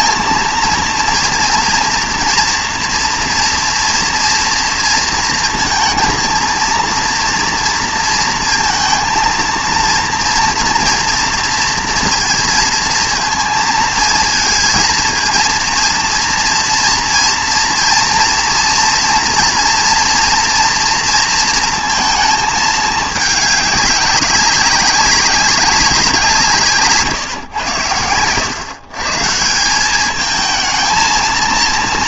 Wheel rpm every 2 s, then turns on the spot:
230, 240, 230, 230, 230, 230, 230, 230, 230, 230, 240, 220, 200, 170, 120, 220.
none